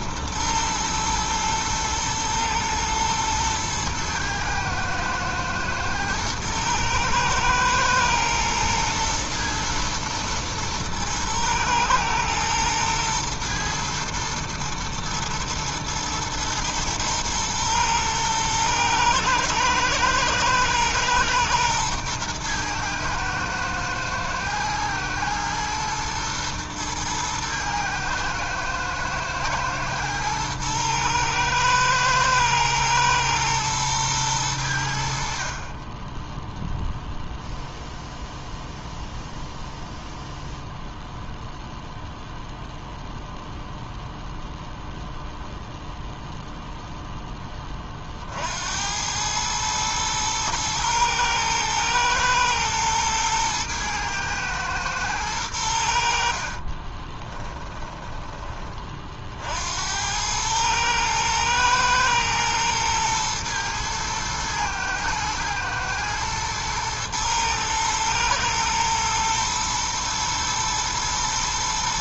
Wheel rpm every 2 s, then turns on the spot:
120, 110, 110, 110, 110, 110, 110, 110, 110, 110, 110, 120, 110, 110, 110, 110, 110, 90, 0, 0, 0, 0, 0, 0, 70, 110, 110, 110, 40, 20, 110, 110, 120, 110, 110, 110.
56-58